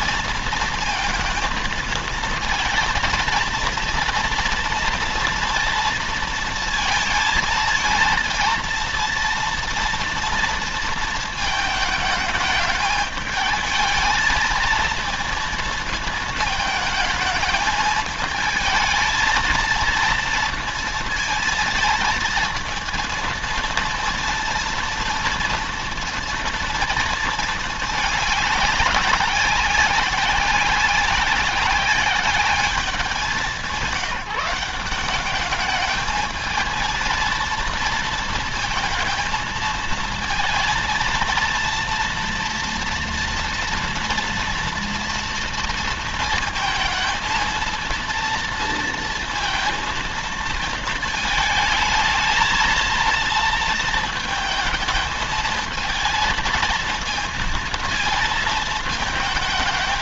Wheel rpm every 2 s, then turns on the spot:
230, 230, 230, 230, 230, 230, 220, 230, 220, 220, 230, 230, 230, 230, 200, 200, 200, 180, 220, 230, 230, 230, 230, 230, 230, 220, 220, 220, 230, 220.
none